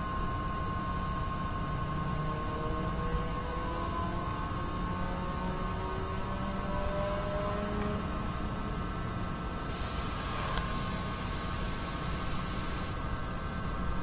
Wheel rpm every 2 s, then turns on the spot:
0, 0, 0, 0, 0, 0, 0.
none